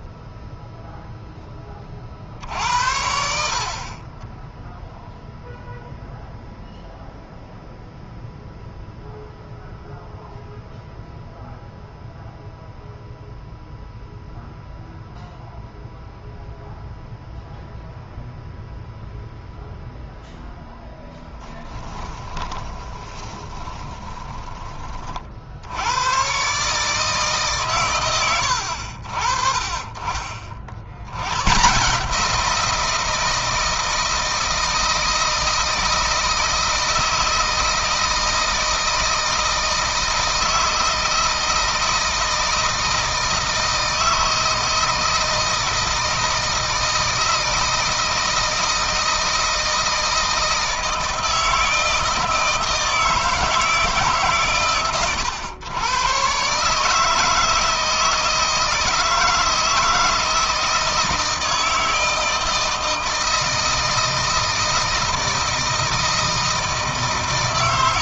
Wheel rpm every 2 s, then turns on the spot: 0, 70, 0, 0, 0, 0, 0, 0, 0, 0, 0, 20, 30, 150, 70, 60, 170, 160, 160, 160, 160, 160, 160, 160, 160, 160, 160, 130, 150, 160, 160, 160, 160, 160.
22-24